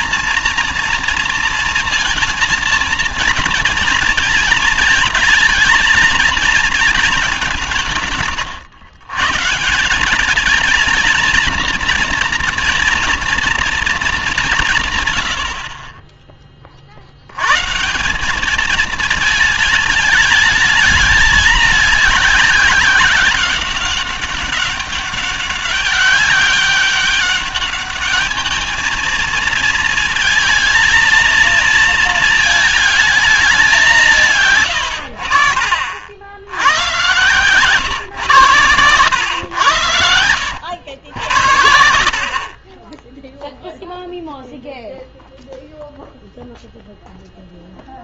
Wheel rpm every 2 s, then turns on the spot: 230, 230, 230, 230, 130, 220, 230, 180, 30, 210, 210, 200, 190, 190, 220, 230, 230, 130, 80, 120, 80, 30, 0, 0.
none